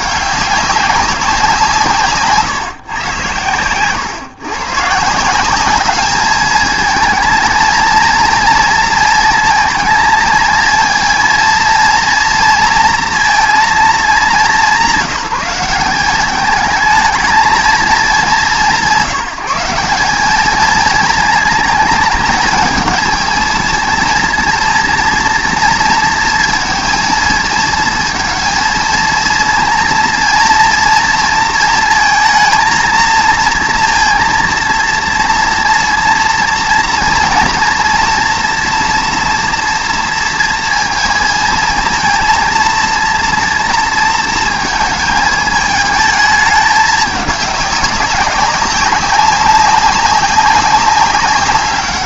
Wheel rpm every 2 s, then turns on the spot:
200, 140, 130, 220, 220, 220, 230, 190, 210, 170, 210, 210, 230, 230, 230, 230, 230, 230, 230, 230, 230, 230, 220, 210, 200, 190.
none